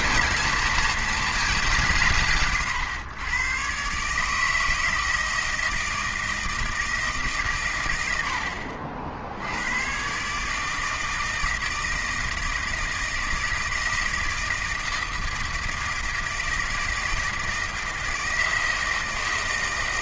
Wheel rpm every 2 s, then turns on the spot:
230, 130, 160, 160, 60, 160, 160, 160, 160, 160.
none